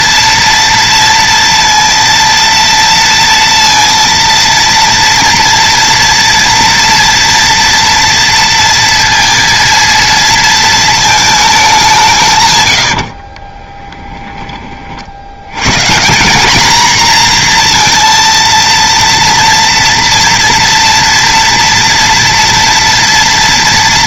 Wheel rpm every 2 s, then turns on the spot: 230, 230, 230, 230, 230, 230, 120, 40, 220, 230, 230, 230.
12-14